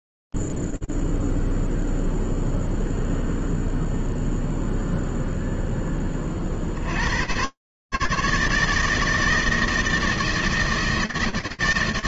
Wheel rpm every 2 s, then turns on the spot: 0, 0, 0, 10, 150, 160.
none